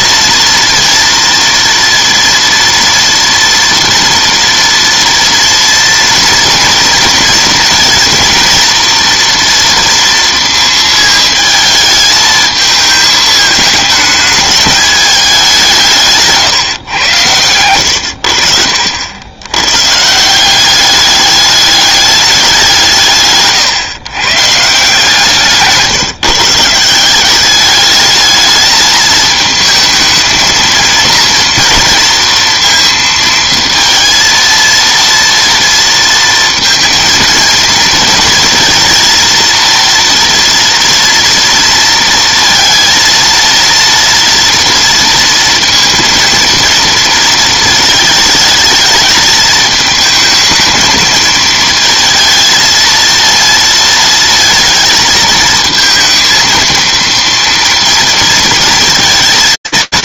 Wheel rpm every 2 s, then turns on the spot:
230, 230, 230, 230, 230, 220, 220, 210, 140, 70, 190, 170, 150, 170, 210, 230, 230, 230, 230, 230, 230, 230, 230, 230, 210, 220, 230, 230, 230, 230.
none